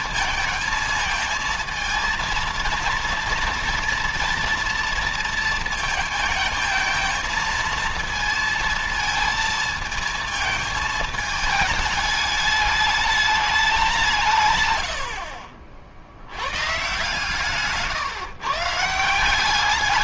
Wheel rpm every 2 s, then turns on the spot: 230, 230, 230, 220, 230, 220, 210, 110, 120, 140.
none